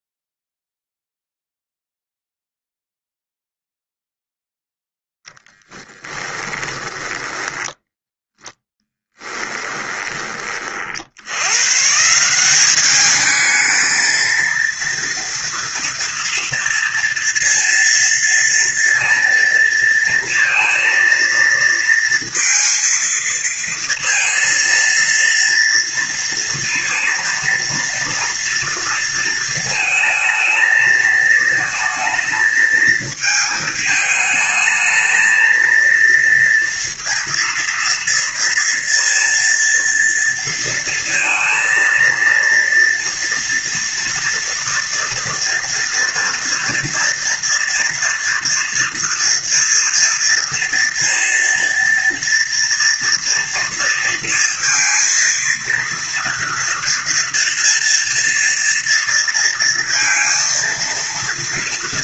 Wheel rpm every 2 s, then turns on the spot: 0, 0, 0, 10, 10, 30, 180, 230, 240, 230, 230, 230, 230, 230, 230, 220, 220, 210, 230, 230, 230, 240, 230, 230, 230, 230, 230, 230, 240, 230, 230.
6-10